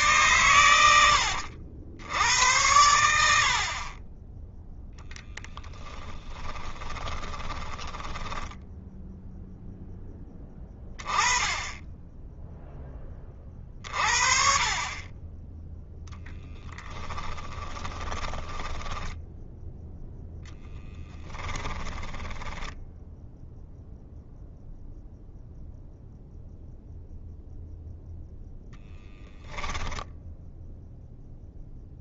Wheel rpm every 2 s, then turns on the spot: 110, 90, 10, 10, 10, 10, 0, 40, 10, 10, 10, 10, 0, 0, 0, 0.
6-10 16-20 22-24